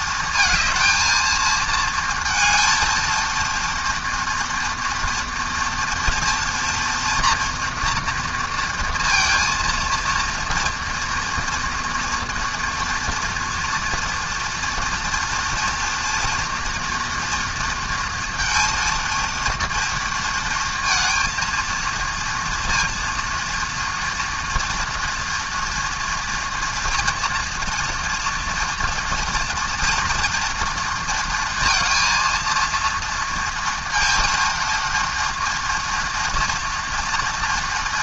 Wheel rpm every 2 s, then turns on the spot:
230, 230, 230, 230, 230, 230, 230, 230, 240, 230, 230, 230, 230, 230, 230, 230, 230, 230, 230.
none